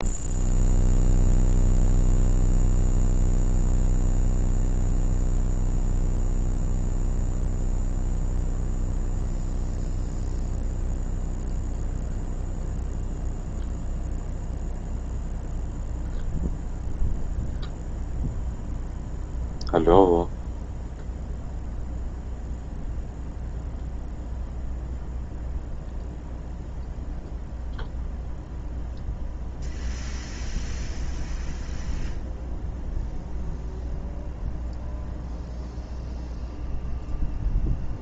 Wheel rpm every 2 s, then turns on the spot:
0, 0, 0, 0, 0, 0, 0, 0, 0, 0, 0, 0, 0, 0, 0, 0, 0, 0, 0.
none